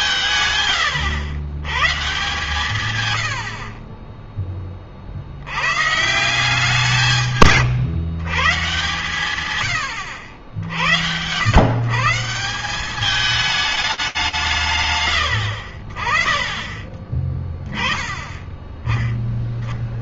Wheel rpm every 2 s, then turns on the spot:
100, 110, 30, 170, 130, 70, 180, 130, 30, 20.
16-18